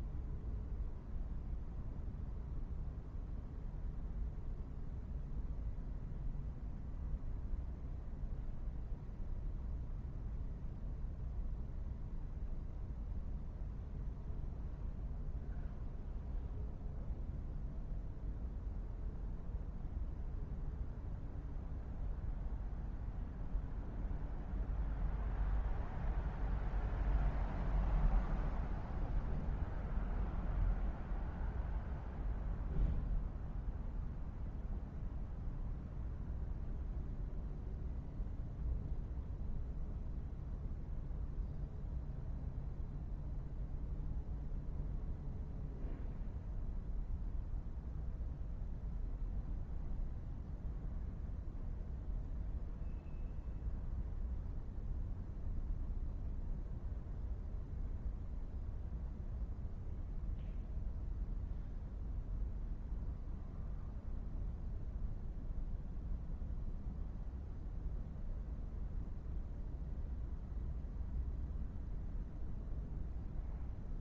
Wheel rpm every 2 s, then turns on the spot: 0, 0, 0, 0, 0, 0, 0, 0, 0, 0, 0, 0, 0, 0, 0, 0, 0, 0, 0, 0, 0, 0, 0, 0, 0, 0, 0, 0, 0, 0, 0, 0, 0, 0, 0, 0, 0.
none